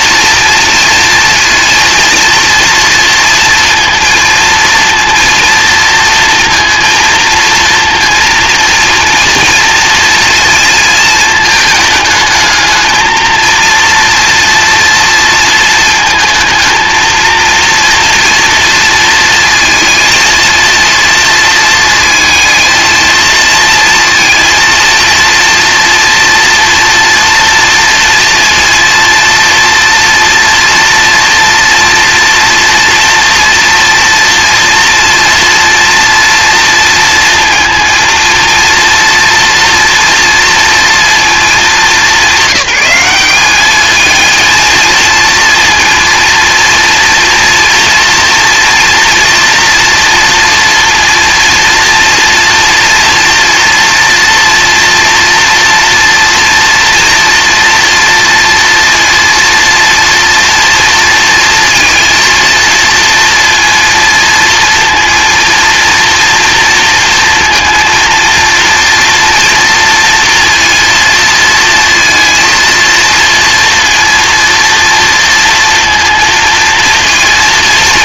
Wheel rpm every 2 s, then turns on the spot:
230, 230, 230, 230, 230, 230, 220, 230, 220, 230, 230, 230, 230, 230, 230, 230, 230, 230, 230, 230, 230, 210, 230, 230, 240, 230, 230, 230, 230, 230, 230, 230, 230, 230, 240, 230, 230, 230, 230.
none